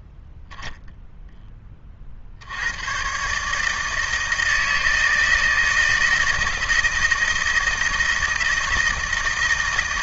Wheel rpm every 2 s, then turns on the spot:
0, 100, 160, 160, 160.
none